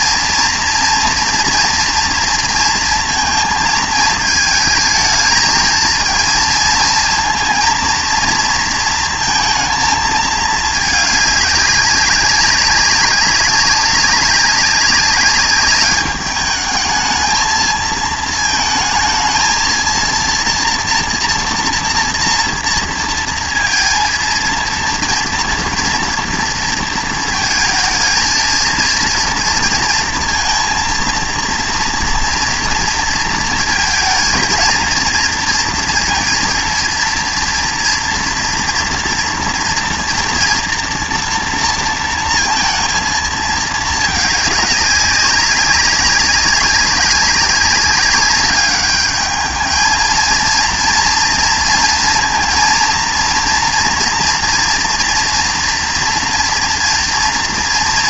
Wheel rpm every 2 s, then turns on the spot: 230, 230, 220, 220, 230, 220, 190, 200, 210, 220, 230, 230, 230, 230, 220, 230, 230, 230, 230, 240, 230, 230, 200, 190, 200, 230, 230, 240, 230.
none